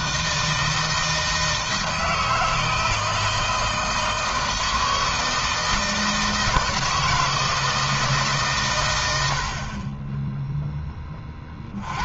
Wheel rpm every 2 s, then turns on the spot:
160, 160, 160, 160, 120, 10.
none